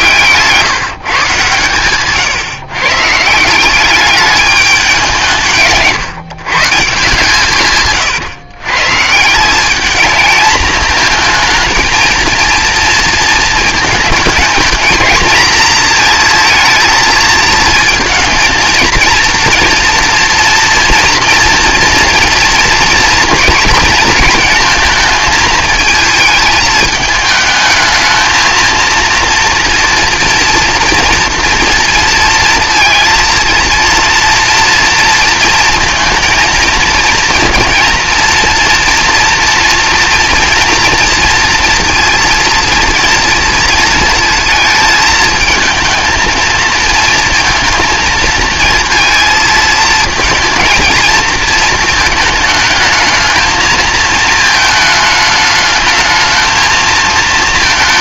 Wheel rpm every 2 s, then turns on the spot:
150, 140, 190, 150, 140, 220, 230, 220, 230, 230, 230, 240, 220, 220, 230, 230, 230, 230, 230, 240, 230, 230, 220, 230, 230, 230, 220, 220, 230.
none